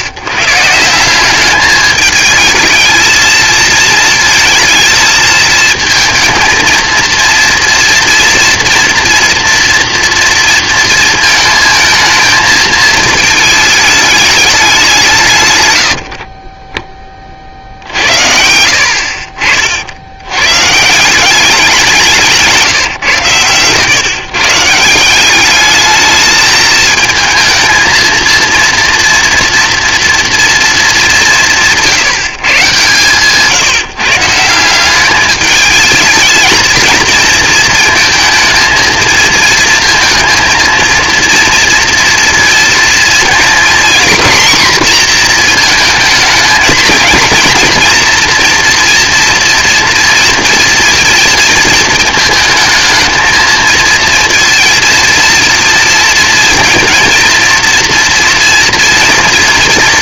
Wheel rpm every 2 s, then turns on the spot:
140, 220, 220, 230, 240, 230, 220, 200, 20, 70, 120, 160, 150, 220, 230, 230, 140, 180, 220, 230, 230, 230, 240, 230, 230, 230, 230, 230, 230, 230.
none